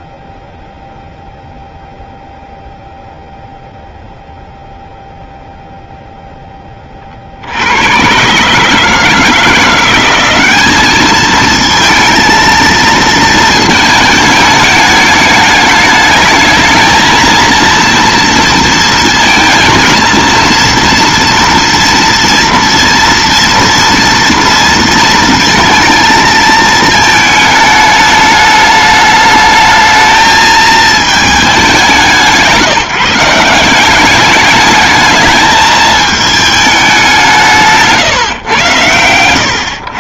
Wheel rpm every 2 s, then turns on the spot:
0, 0, 0, 40, 160, 210, 230, 210, 220, 230, 230, 230, 230, 220, 210, 220, 160, 210, 190, 110.
none